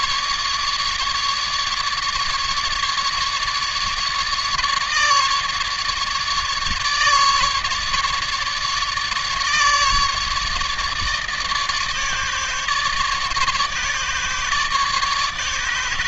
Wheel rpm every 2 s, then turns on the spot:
150, 150, 150, 150, 150, 150, 150, 150.
none